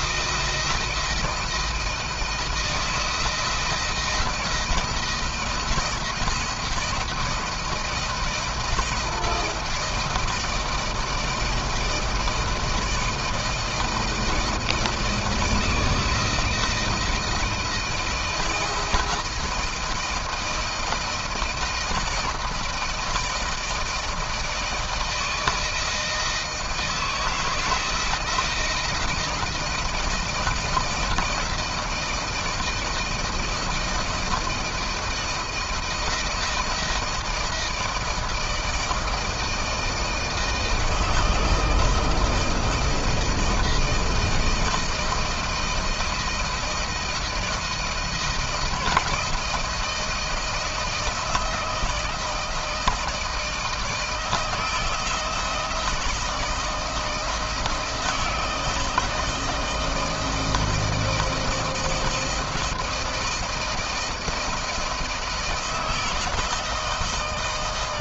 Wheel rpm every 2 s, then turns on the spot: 170, 170, 170, 170, 160, 170, 160, 160, 170, 170, 160, 160, 160, 160, 170, 160, 160, 170, 160, 160, 160, 160, 160, 170, 160, 160, 160, 160, 160, 160, 160, 160, 160, 160.
none